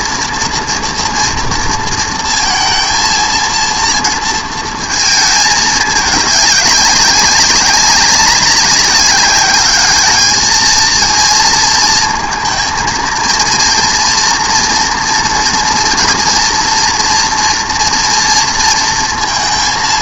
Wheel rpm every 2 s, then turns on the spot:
230, 230, 230, 200, 190, 220, 230, 230, 230, 230.
none